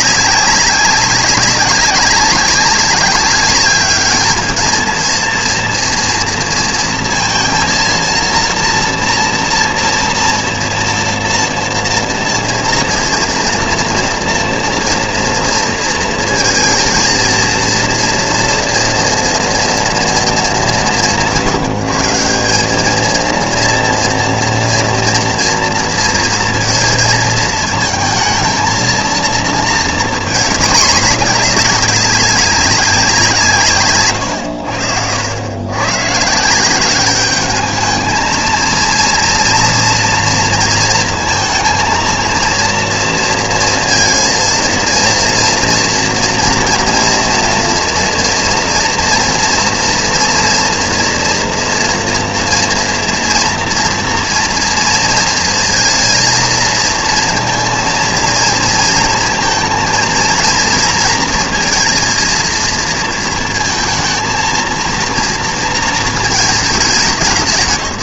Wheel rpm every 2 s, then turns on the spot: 200, 200, 220, 230, 230, 230, 230, 240, 220, 240, 180, 190, 230, 230, 220, 220, 200, 100, 180, 220, 230, 230, 230, 240, 230, 230, 230, 230, 220, 230, 230, 230, 230, 220.
34-36